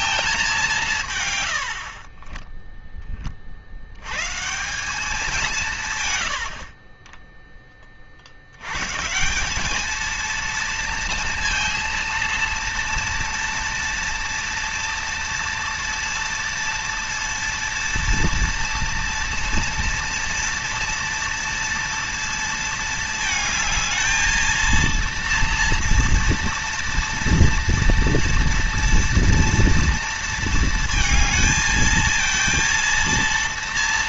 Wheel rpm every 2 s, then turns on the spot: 180, 10, 170, 60, 90, 230, 230, 230, 230, 230, 230, 230, 230, 230, 230, 230, 230.
2-4